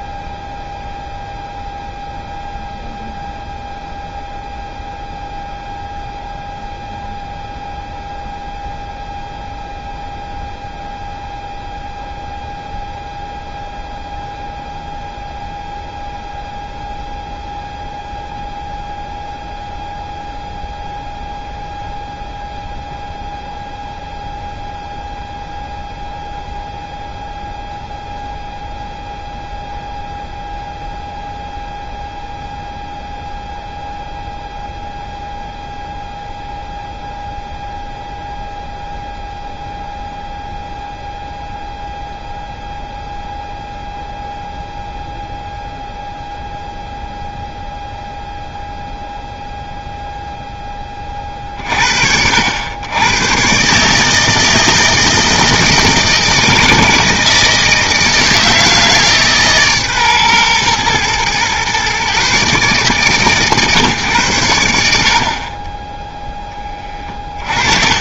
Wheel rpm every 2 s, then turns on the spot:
0, 0, 0, 0, 0, 0, 0, 0, 0, 0, 0, 0, 0, 0, 0, 0, 0, 0, 0, 0, 0, 0, 0, 0, 0, 40, 120, 160, 160, 150, 120, 140, 50, 20.
66-68